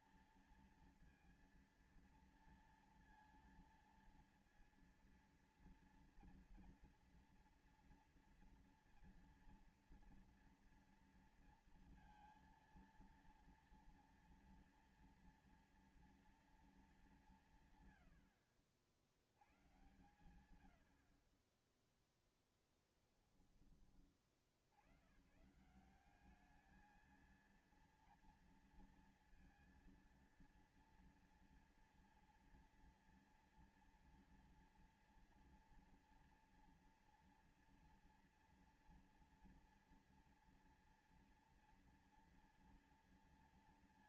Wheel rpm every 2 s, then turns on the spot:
230, 230, 230, 230, 240, 230, 230, 230, 230, 90, 120, 10, 50, 200, 230, 230, 230, 230, 230, 230, 230, 230.
none